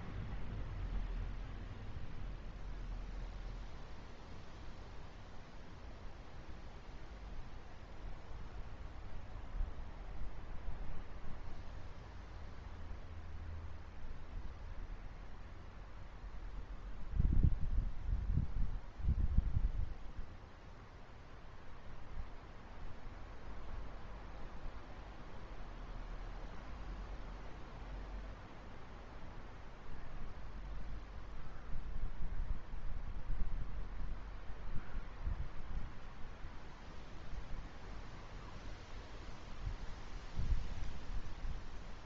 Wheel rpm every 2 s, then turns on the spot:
0, 0, 0, 0, 0, 0, 0, 0, 0, 0, 0, 0, 0, 0, 0, 0, 0, 0, 0, 0, 0.
none